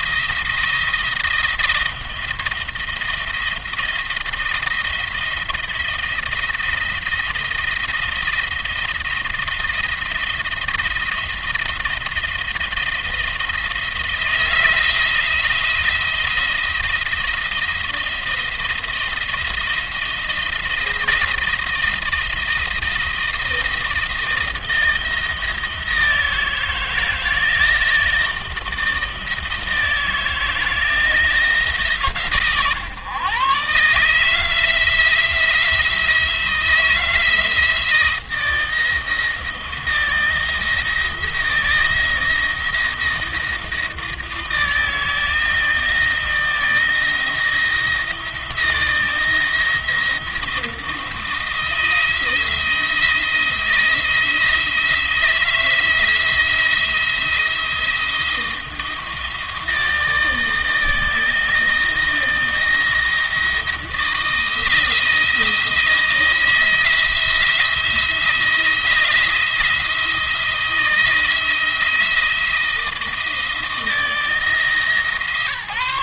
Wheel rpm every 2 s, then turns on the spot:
170, 170, 170, 170, 170, 170, 160, 160, 170, 170, 170, 160, 170, 160, 160, 170, 120, 160, 170, 160, 160, 170, 160, 170, 160, 170, 170, 160, 170, 170, 160, 170, 160, 170, 170, 170, 160, 160.
none